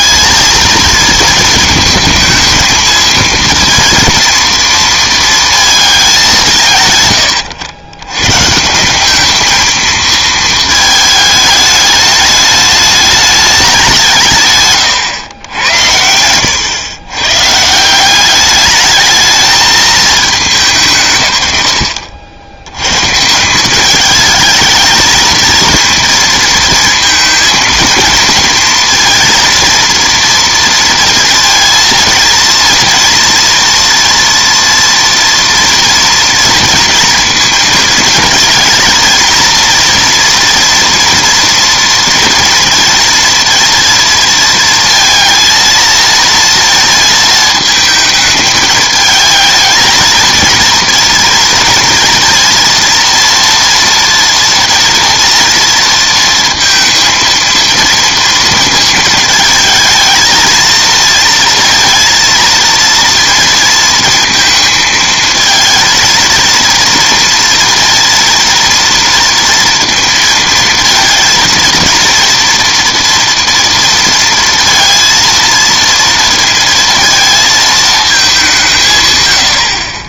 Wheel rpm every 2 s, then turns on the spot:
220, 220, 230, 160, 150, 220, 210, 140, 110, 200, 190, 80, 210, 230, 230, 230, 230, 230, 230, 220, 230, 230, 230, 230, 220, 230, 230, 230, 230, 230, 230, 230, 220, 230, 230, 230, 230, 230, 230, 190.
14-16